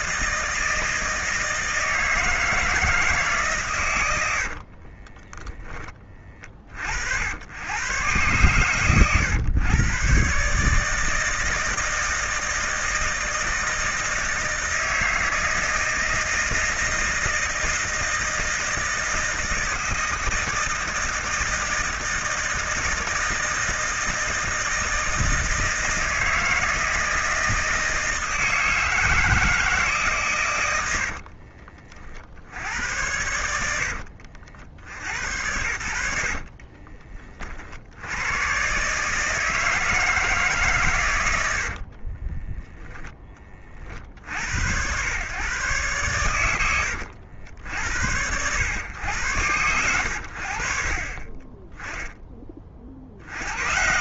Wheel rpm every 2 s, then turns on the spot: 160, 160, 60, 30, 120, 140, 160, 160, 160, 160, 160, 160, 160, 160, 160, 110, 60, 60, 50, 110, 150, 20, 80, 90, 100, 60, 20.
4-6 36-38 42-44